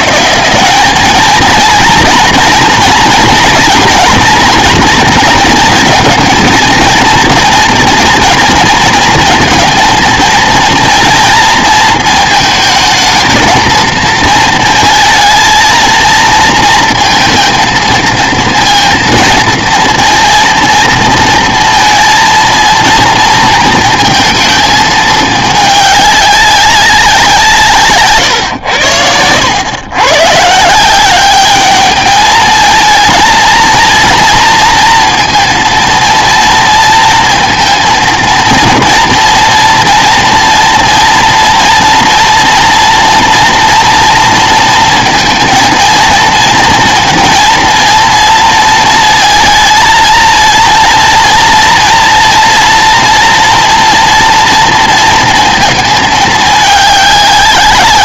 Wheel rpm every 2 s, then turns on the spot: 190, 240, 240, 230, 230, 230, 220, 230, 230, 230, 230, 230, 220, 190, 100, 170, 220, 230, 230, 230, 230, 240, 230, 230, 230, 230, 240, 230, 210.
none